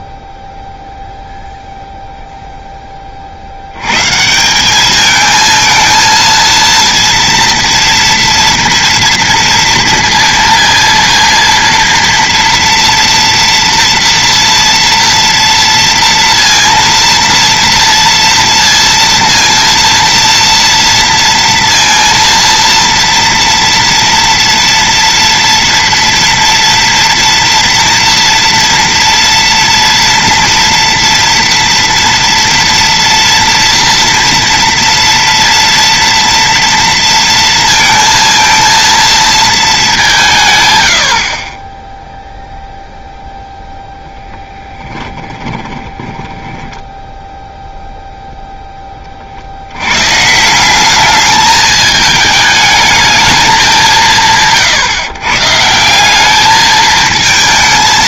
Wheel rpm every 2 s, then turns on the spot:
0, 10, 200, 230, 230, 230, 230, 230, 230, 230, 230, 230, 230, 230, 230, 230, 230, 230, 230, 230, 90, 0, 10, 10, 10, 180, 210, 160, 220.
44-48